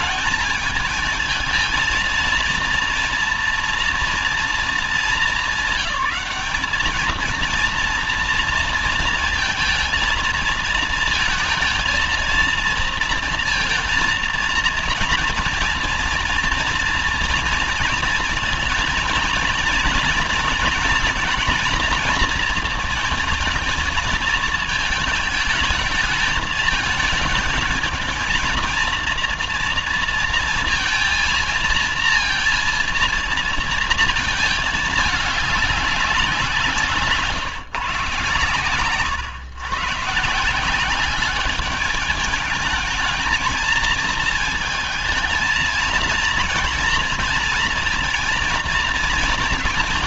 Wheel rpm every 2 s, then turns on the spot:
220, 230, 230, 220, 230, 230, 230, 230, 230, 230, 230, 230, 220, 220, 230, 230, 230, 220, 170, 120, 160, 210, 220, 230, 230.
38-40